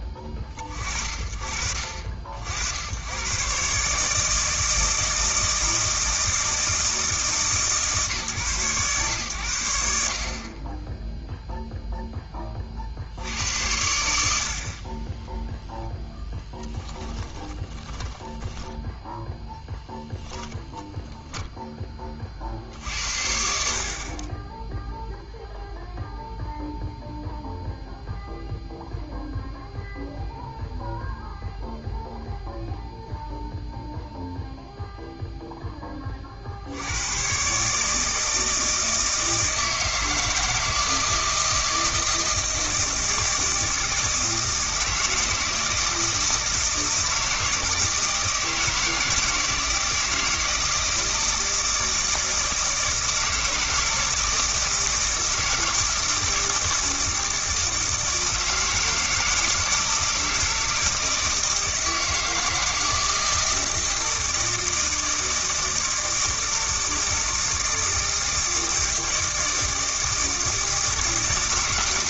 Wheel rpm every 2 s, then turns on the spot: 10, 100, 160, 160, 120, 20, 20, 80, 10, 10, 10, 60, 10, 0, 0, 0, 0, 0, 70, 160, 160, 160, 160, 160, 160, 160, 160, 160, 160, 160, 160, 160, 160, 160, 160, 160.
16-22